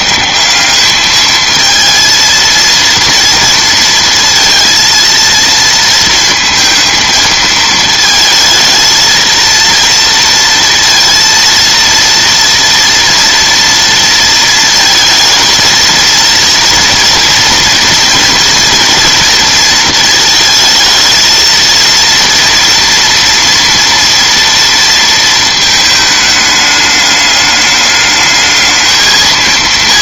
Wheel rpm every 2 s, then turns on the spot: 190, 230, 230, 230, 220, 230, 230, 230, 230, 230, 220, 230, 230, 210, 220.
none